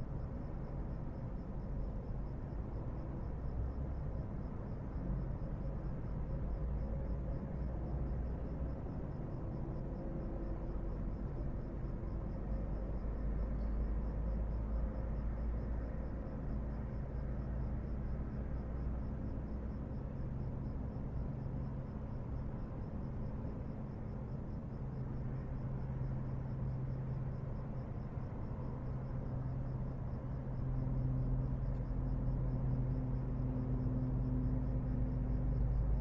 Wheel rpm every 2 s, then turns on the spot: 0, 0, 0, 0, 0, 0, 0, 0, 0, 0, 0, 0, 0, 0, 0, 0, 0, 0.
none